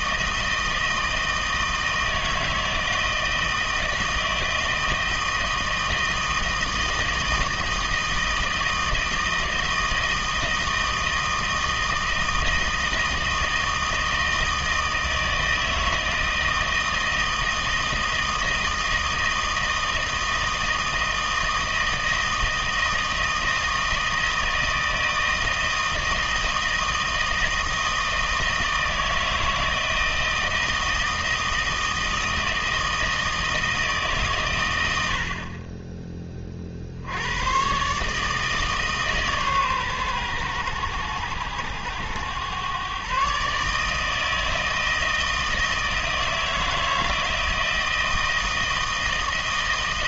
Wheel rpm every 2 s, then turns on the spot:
160, 160, 160, 160, 160, 160, 160, 160, 160, 160, 160, 160, 160, 160, 160, 160, 160, 100, 60, 150, 110, 120, 160, 160, 160.
none